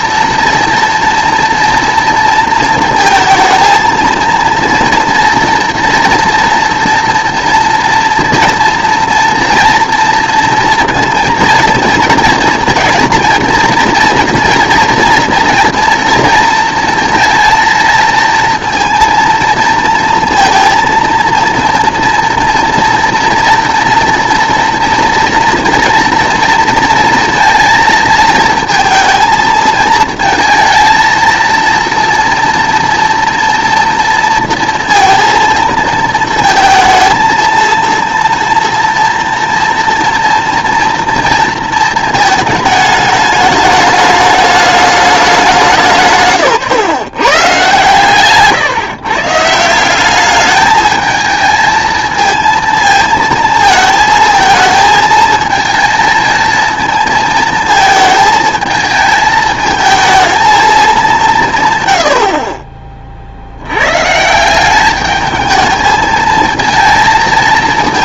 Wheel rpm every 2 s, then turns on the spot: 230, 230, 230, 230, 230, 230, 230, 230, 230, 230, 230, 230, 230, 230, 230, 230, 230, 230, 220, 240, 230, 220, 210, 130, 150, 210, 230, 230, 220, 220, 210, 30, 190, 220.
none